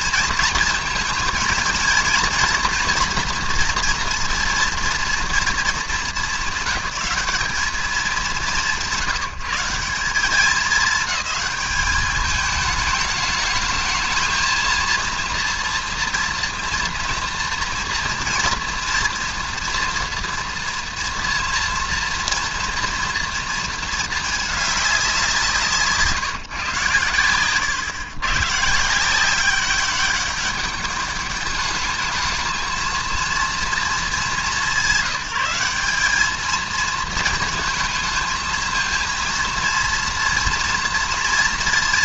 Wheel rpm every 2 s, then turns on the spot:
220, 230, 240, 190, 160, 200, 210, 230, 230, 230, 230, 230, 200, 120, 150, 200, 220, 190, 220, 220, 230.
none